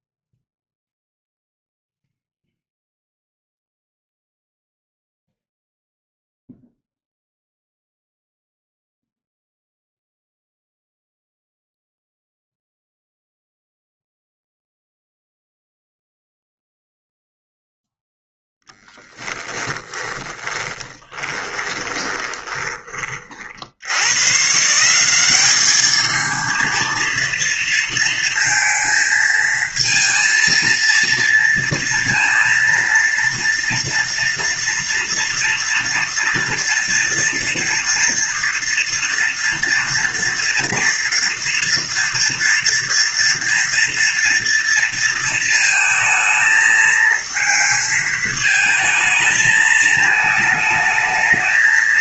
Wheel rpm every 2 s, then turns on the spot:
0, 0, 0, 0, 0, 0, 0, 0, 0, 0, 10, 30, 190, 230, 220, 230, 230, 230, 240, 240, 230, 230, 230, 220, 220, 220.
20-22